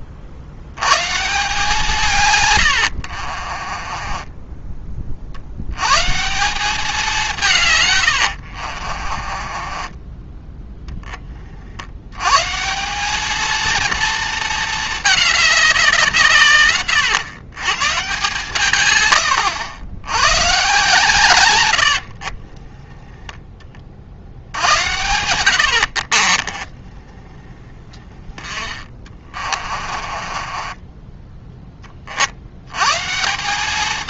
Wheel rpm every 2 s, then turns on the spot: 140, 70, 30, 190, 40, 20, 190, 210, 130, 120, 130, 10, 100, 20, 30, 10, 140.
2-4 8-10 26-32